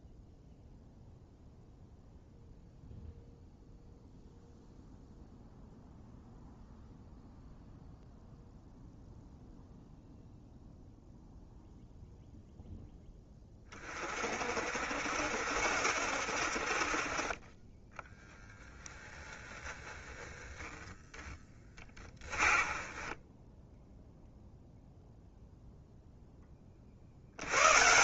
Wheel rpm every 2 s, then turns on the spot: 0, 0, 0, 0, 0, 0, 10, 60, 50, 30, 10, 20, 0, 30.
18-20 22-24